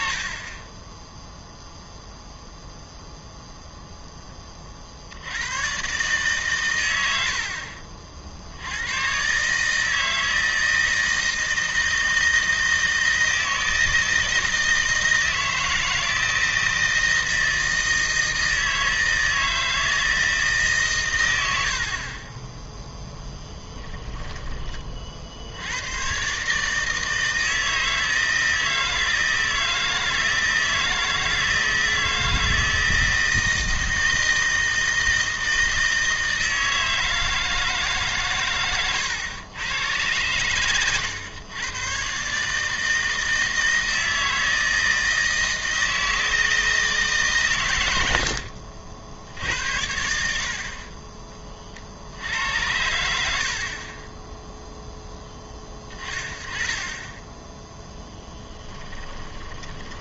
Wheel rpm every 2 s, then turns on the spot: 10, 0, 40, 100, 90, 160, 160, 160, 160, 160, 140, 10, 30, 150, 160, 160, 160, 160, 160, 120, 120, 150, 160, 160, 70, 50, 80, 0, 20, 20.
58-60